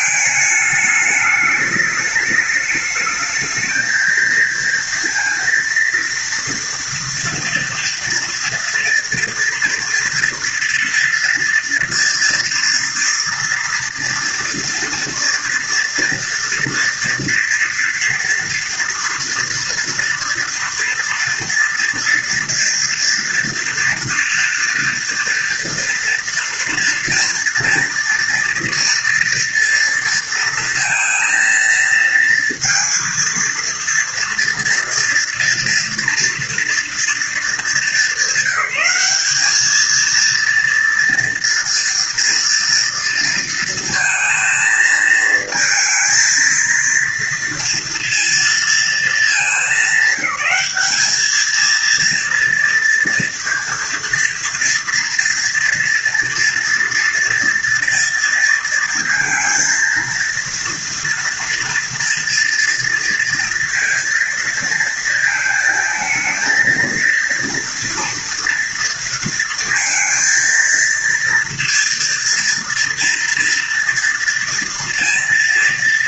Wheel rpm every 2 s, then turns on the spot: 210, 220, 230, 230, 230, 230, 230, 230, 230, 240, 230, 230, 230, 230, 230, 230, 230, 230, 230, 200, 230, 230, 220, 230, 220, 210, 230, 230, 230, 230, 230, 230, 230, 230, 230, 230, 230, 230.
none